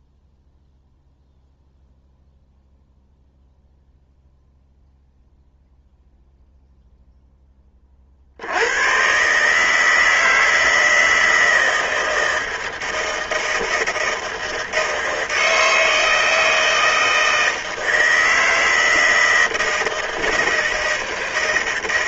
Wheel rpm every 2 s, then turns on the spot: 0, 0, 0, 0, 100, 160, 160, 160, 160, 160, 160.
none